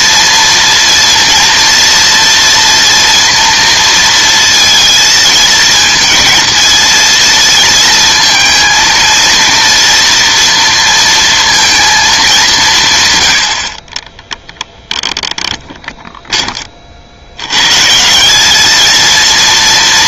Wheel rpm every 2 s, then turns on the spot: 230, 230, 220, 230, 230, 230, 160, 0, 20, 210.
none